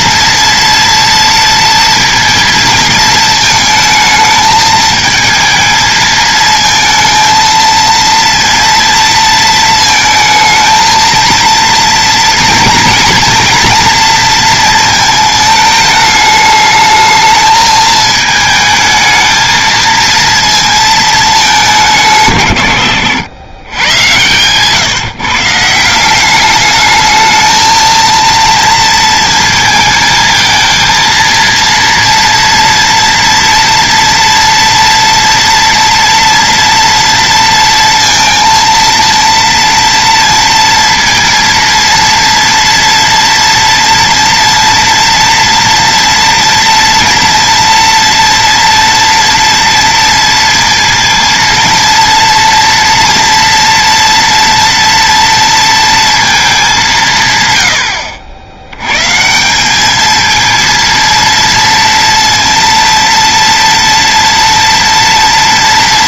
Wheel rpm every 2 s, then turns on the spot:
230, 230, 220, 220, 230, 220, 230, 230, 220, 220, 230, 130, 130, 210, 230, 220, 230, 230, 230, 230, 230, 230, 240, 230, 240, 230, 230, 230, 210, 90, 220, 230, 230.
none